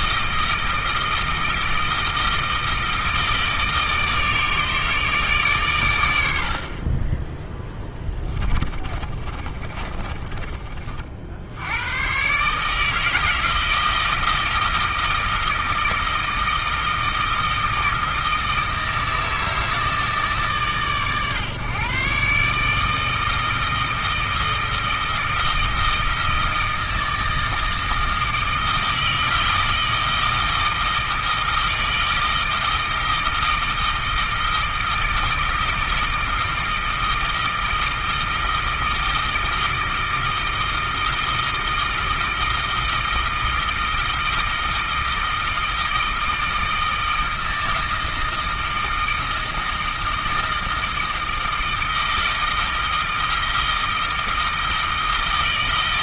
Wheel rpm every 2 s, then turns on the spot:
160, 160, 150, 40, 40, 40, 160, 160, 160, 160, 140, 160, 160, 160, 160, 160, 160, 160, 160, 160, 160, 160, 160, 160, 160, 160, 160, 160.
8-10